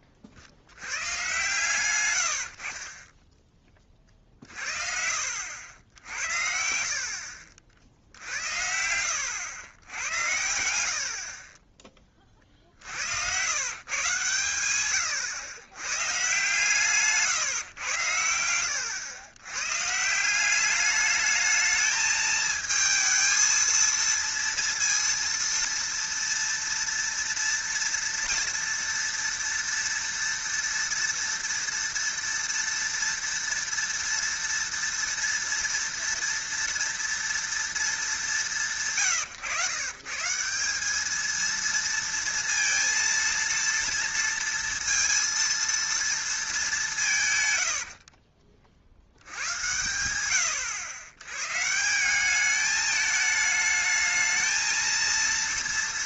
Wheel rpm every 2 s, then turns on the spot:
50, 60, 50, 70, 70, 70, 50, 120, 150, 90, 200, 220, 230, 240, 230, 230, 230, 230, 230, 160, 180, 230, 230, 210, 50, 90, 210, 220.
none